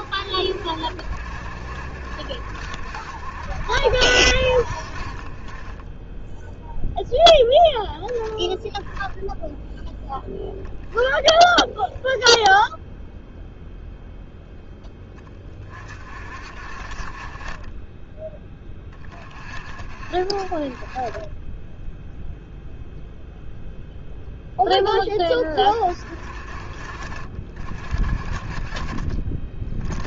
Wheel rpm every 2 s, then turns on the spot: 60, 70, 60, 0, 0, 10, 0, 10, 40, 20, 30, 0, 20, 50, 40.
none